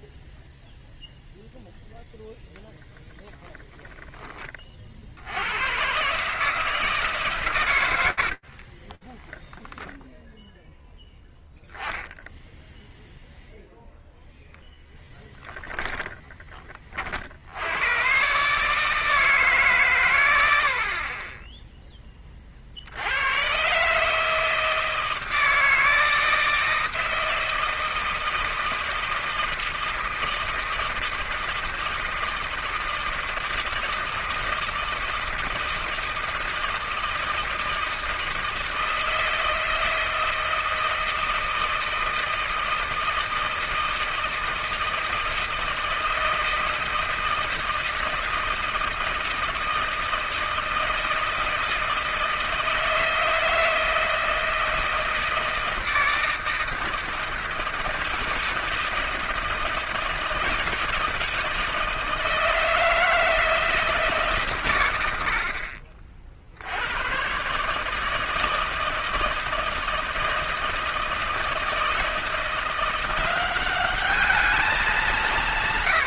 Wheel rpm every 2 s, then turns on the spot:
0, 0, 20, 160, 80, 0, 0, 10, 20, 150, 40, 70, 160, 160, 160, 160, 160, 160, 160, 160, 160, 160, 160, 160, 160, 160, 160, 160, 160, 160, 160, 160, 140, 70, 160, 160, 170, 210.
8-10